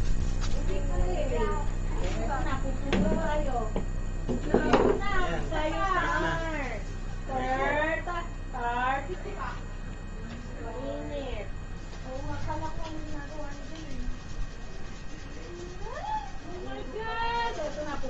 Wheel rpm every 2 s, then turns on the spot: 0, 0, 0, 0, 0, 0, 0, 0, 0.
none